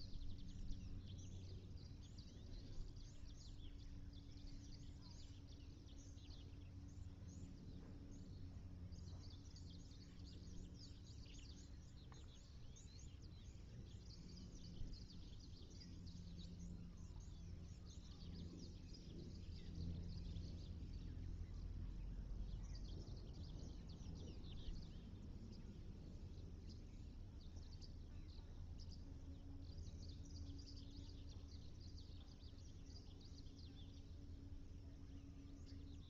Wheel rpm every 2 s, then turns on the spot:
0, 0, 0, 0, 0, 0, 0, 0, 0, 0, 0, 0, 0, 0, 0, 0, 0, 0.
none